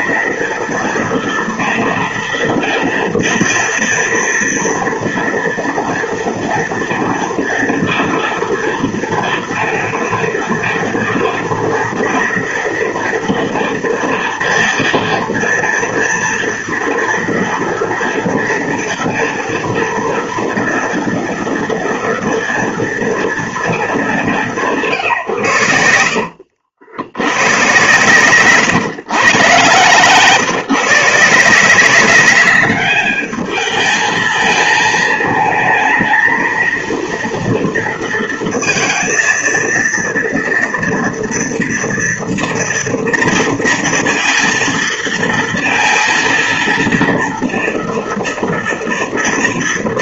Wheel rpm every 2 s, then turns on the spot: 230, 230, 230, 230, 230, 230, 230, 230, 230, 230, 230, 230, 160, 80, 130, 150, 200, 220, 230, 230, 230, 230, 230, 230, 230.
none